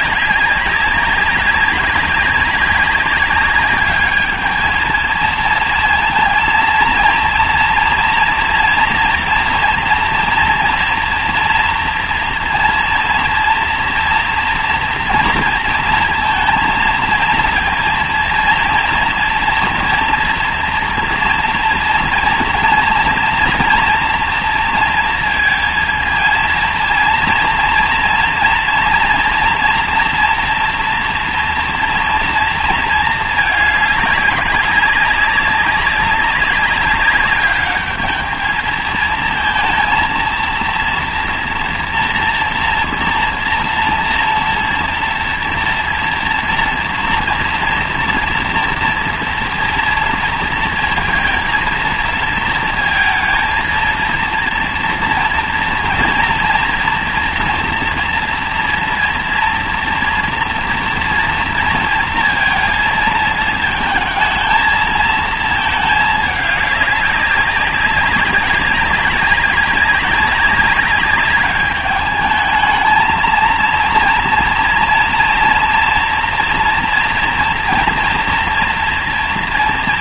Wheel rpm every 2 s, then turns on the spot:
200, 190, 220, 230, 230, 230, 230, 230, 230, 230, 230, 230, 230, 230, 230, 240, 220, 200, 200, 220, 230, 230, 230, 230, 240, 230, 230, 230, 240, 230, 230, 230, 220, 200, 200, 190, 220, 230, 230, 230.
none